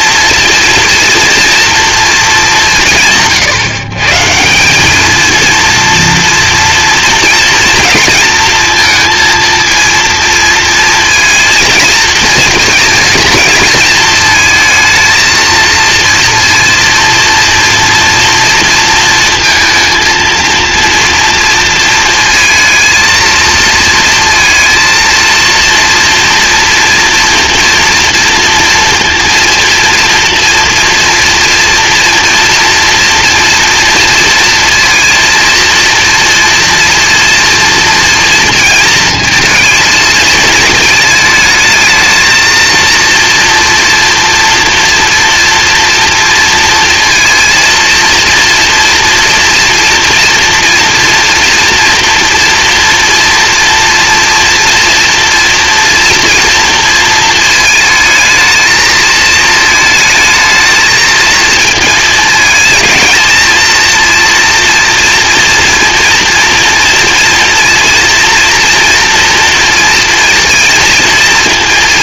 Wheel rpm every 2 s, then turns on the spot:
230, 140, 210, 230, 230, 230, 230, 220, 230, 230, 230, 220, 230, 240, 230, 230, 230, 230, 230, 230, 220, 230, 230, 230, 230, 230, 230, 240, 230, 220, 220, 220, 230, 230, 230, 210.
none